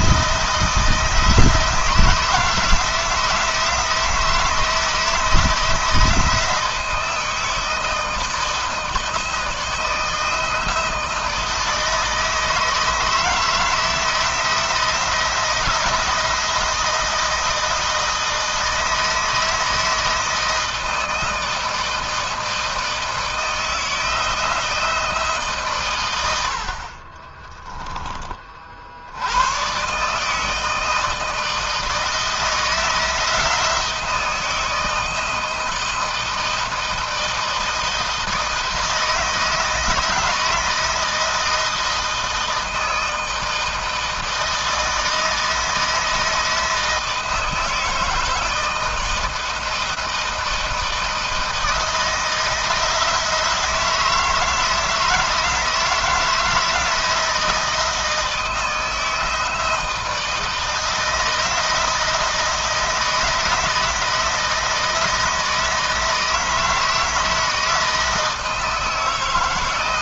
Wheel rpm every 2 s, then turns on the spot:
170, 160, 160, 160, 160, 160, 160, 170, 160, 160, 160, 160, 170, 60, 50, 160, 160, 160, 160, 160, 160, 160, 160, 160, 160, 160, 160, 160, 160, 160, 160, 160, 160, 160, 160.
26-28